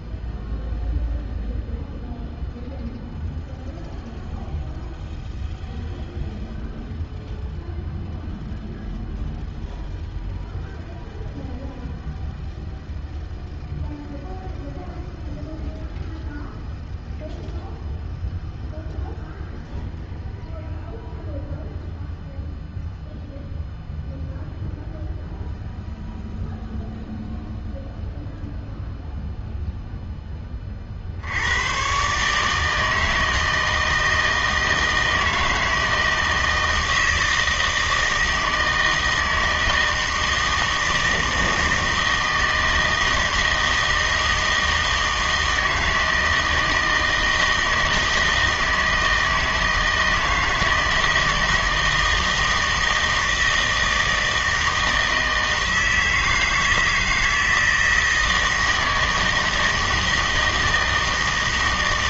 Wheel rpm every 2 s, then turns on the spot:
0, 0, 0, 0, 0, 0, 0, 0, 0, 0, 0, 0, 0, 0, 0, 30, 150, 160, 160, 160, 160, 160, 160, 160, 160, 160, 160, 160, 160, 160, 160.
none